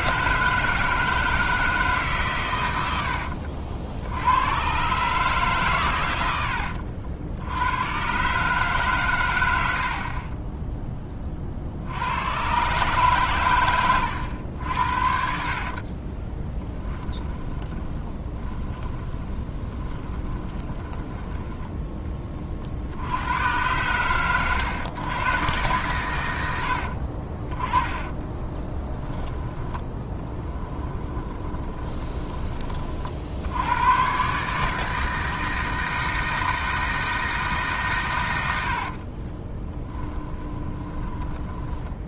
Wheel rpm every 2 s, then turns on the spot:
160, 90, 120, 70, 140, 10, 130, 70, 20, 20, 20, 60, 110, 60, 20, 20, 40, 160, 160, 60, 20.
16-22 26-32 38-42